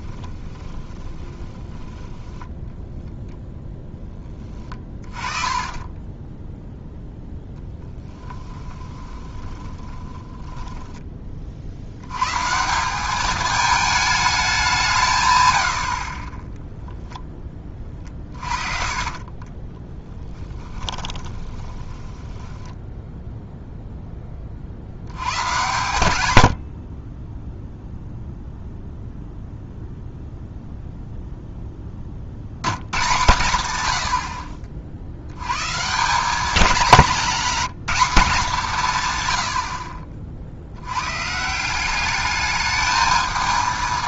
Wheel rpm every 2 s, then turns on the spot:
10, 10, 20, 0, 20, 30, 160, 190, 0, 30, 20, 10, 70, 60, 0, 0, 90, 50, 200, 160, 80, 220.
0-2 4-6 8-12 18-22 26-28